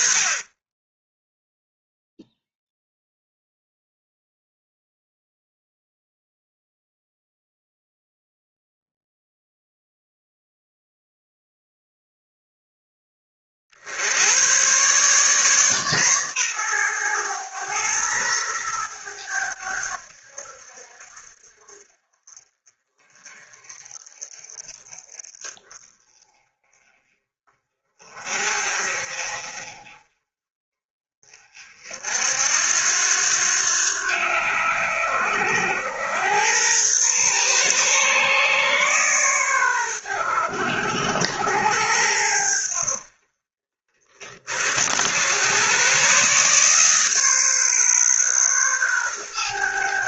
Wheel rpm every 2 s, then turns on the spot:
10, 0, 0, 0, 0, 0, 10, 120, 120, 110, 70, 40, 40, 30, 40, 40, 80, 80, 110, 130, 80, 70, 70, 140, 120.
none